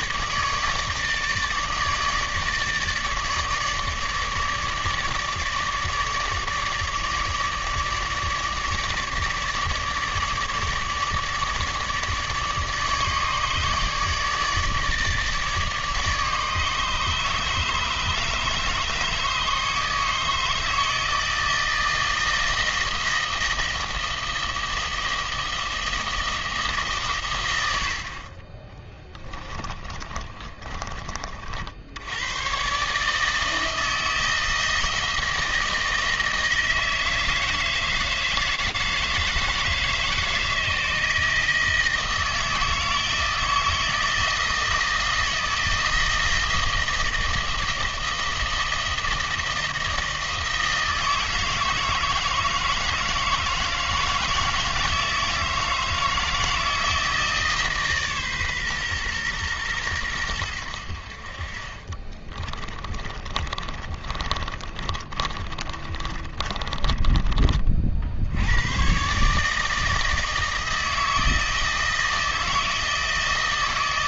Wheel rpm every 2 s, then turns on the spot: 150, 160, 150, 150, 150, 150, 150, 150, 150, 150, 160, 160, 160, 150, 30, 30, 120, 160, 160, 160, 160, 160, 160, 160, 160, 160, 160, 160, 160, 130, 80, 20, 30, 20, 110, 160, 160.
28-32 62-68